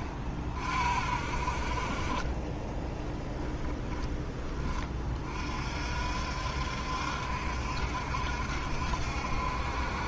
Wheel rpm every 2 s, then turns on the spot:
40, 30, 20, 70, 70.
2-4